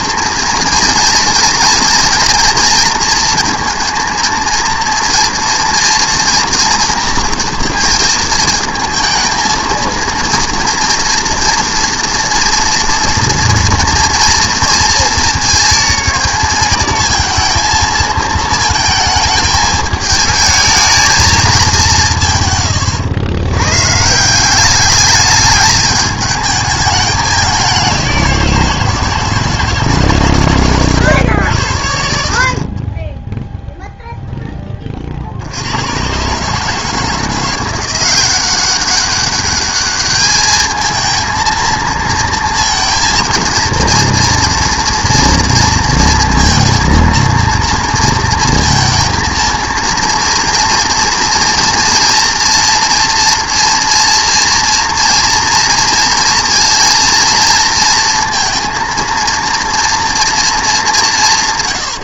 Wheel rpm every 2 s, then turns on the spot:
230, 230, 230, 230, 220, 240, 230, 230, 220, 220, 220, 120, 190, 210, 170, 120, 50, 10, 140, 190, 220, 230, 230, 230, 230, 240, 230, 230, 230, 230, 220.
none